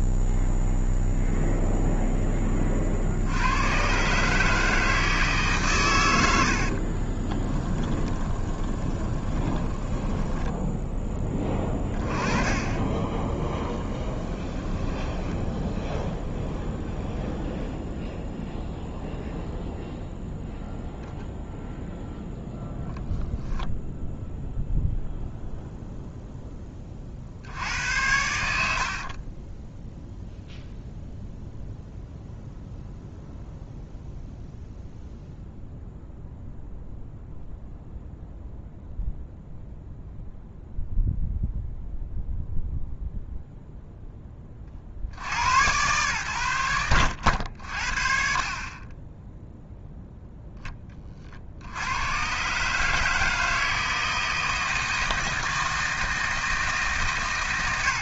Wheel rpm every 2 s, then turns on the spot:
0, 50, 150, 30, 20, 10, 10, 10, 0, 0, 0, 10, 0, 40, 50, 0, 0, 0, 0, 0, 0, 0, 50, 80, 20, 20, 150, 160, 140.
6-10 12-16 22-24 28-30